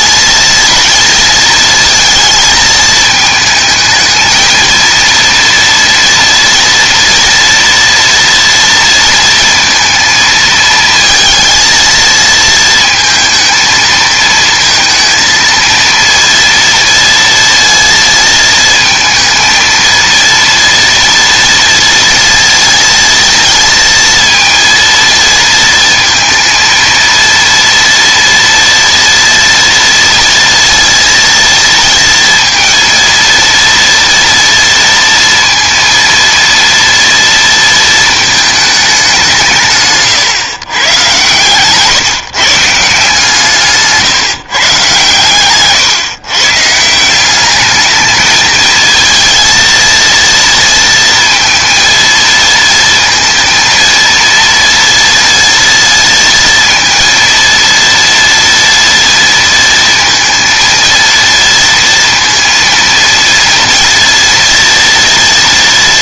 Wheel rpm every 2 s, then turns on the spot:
230, 220, 230, 230, 230, 230, 230, 230, 230, 220, 230, 230, 230, 230, 240, 230, 230, 230, 230, 210, 120, 150, 140, 160, 230, 230, 230, 230, 230, 230, 230, 230, 230.
none